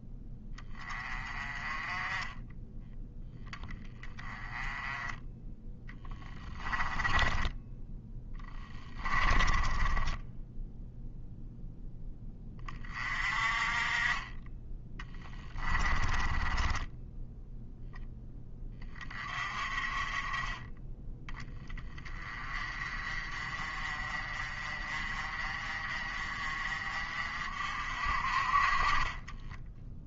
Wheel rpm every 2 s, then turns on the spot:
20, 10, 10, 20, 20, 0, 30, 20, 10, 30, 20, 30, 40, 40, 30.
6-10 14-18